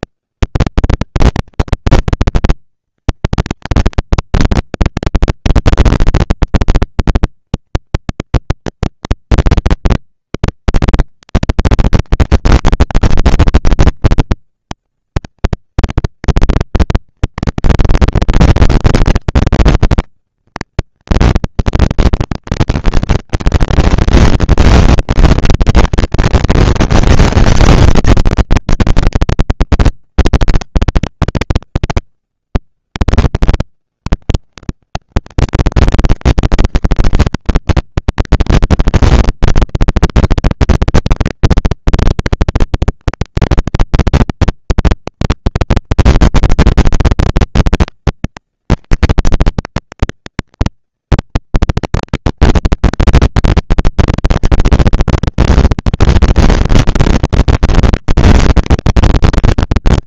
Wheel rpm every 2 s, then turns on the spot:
180, 230, 230, 230, 230, 220, 240, 230, 230, 230, 230, 230, 230, 230, 210, 190, 110, 160, 220, 230, 230, 240, 230, 230, 220, 230, 230, 240, 230, 230.
none